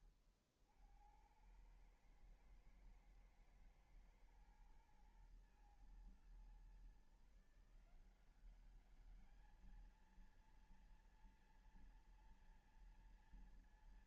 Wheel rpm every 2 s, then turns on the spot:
70, 110, 110, 120, 190, 230, 230.
none